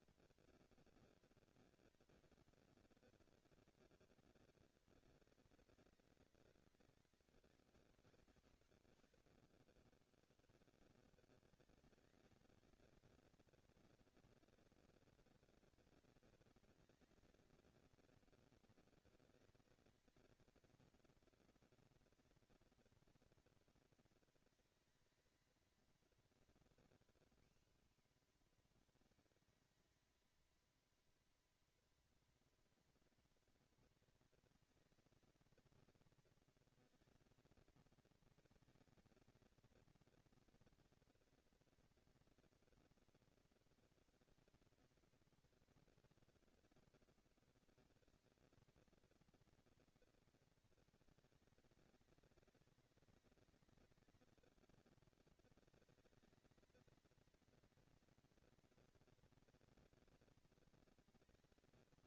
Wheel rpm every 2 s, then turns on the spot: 230, 230, 210, 190, 180, 140, 210, 230, 230, 230, 220, 230, 230, 240, 240, 230, 230, 230, 220, 220, 230, 240, 230, 230, 230, 220, 190, 200, 220, 240, 230.
none